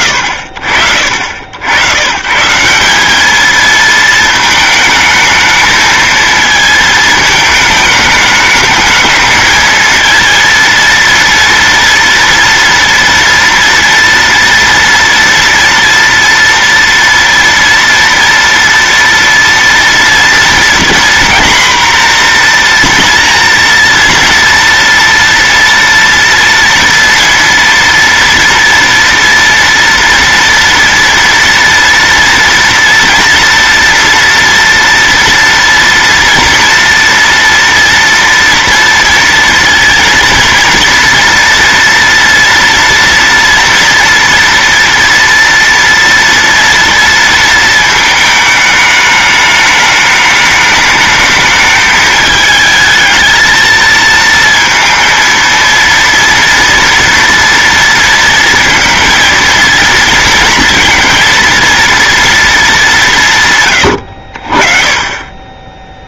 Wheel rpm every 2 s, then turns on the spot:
70, 180, 220, 220, 220, 230, 230, 230, 230, 230, 240, 240, 230, 230, 240, 230, 230, 230, 230, 230, 230, 230, 230, 230, 220, 210, 220, 230, 230, 230, 230, 210, 40.
none